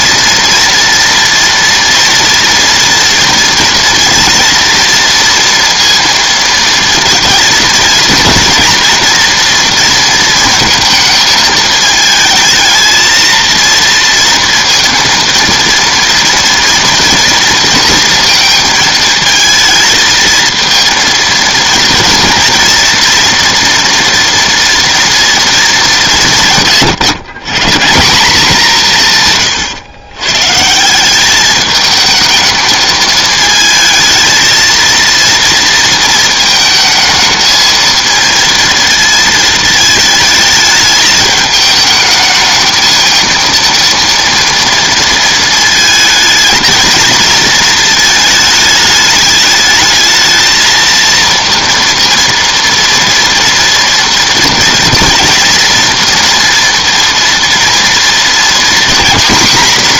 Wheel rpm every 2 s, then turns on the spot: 230, 230, 230, 220, 230, 220, 220, 230, 230, 220, 230, 240, 240, 120, 160, 190, 220, 230, 220, 230, 210, 220, 230, 220, 210, 230, 230, 230, 230, 240.
none